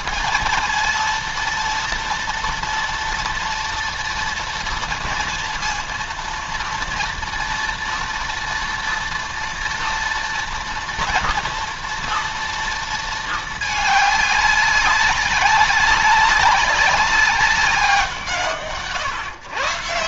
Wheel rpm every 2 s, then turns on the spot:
230, 230, 230, 230, 230, 230, 230, 200, 190, 150.
none